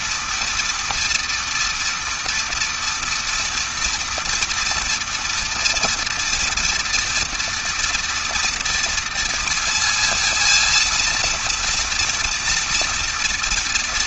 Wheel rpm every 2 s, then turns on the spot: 230, 230, 230, 240, 230, 230, 230.
none